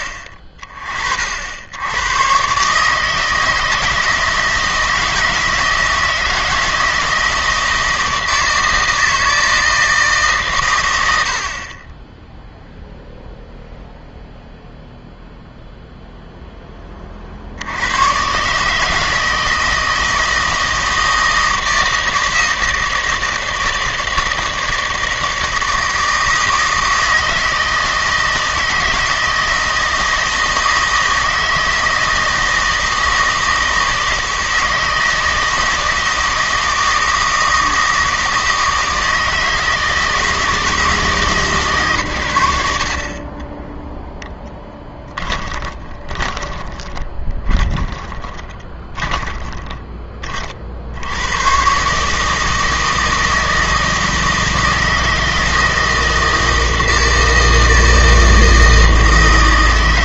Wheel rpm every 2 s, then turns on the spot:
30, 150, 160, 160, 160, 120, 0, 0, 20, 150, 160, 160, 160, 160, 160, 160, 160, 160, 160, 160, 160, 60, 10, 20, 20, 60, 160, 160, 160, 160.
44-50